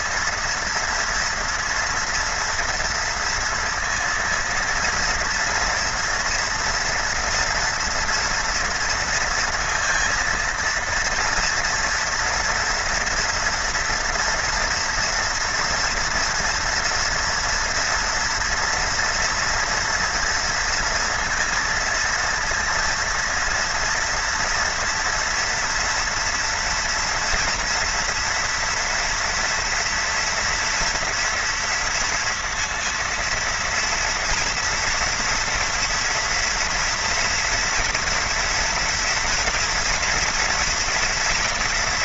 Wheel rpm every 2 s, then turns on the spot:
230, 230, 230, 230, 230, 230, 230, 240, 240, 240, 230, 230, 230, 240, 240, 240, 230, 230, 230, 230, 230.
none